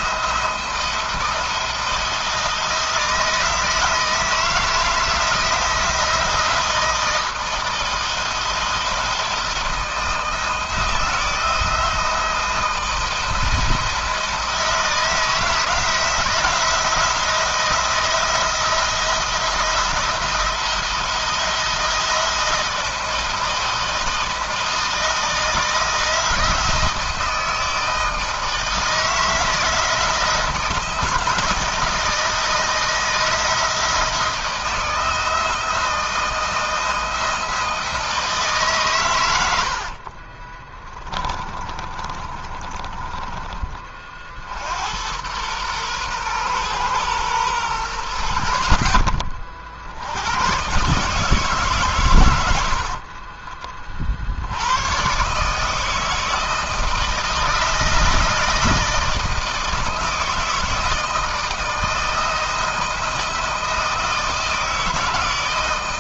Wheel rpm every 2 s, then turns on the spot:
170, 170, 160, 160, 170, 160, 170, 170, 170, 170, 170, 170, 160, 160, 160, 160, 160, 160, 160, 130, 20, 30, 80, 120, 70, 140, 50, 110, 160, 160, 160, 170, 160.
40-44 52-54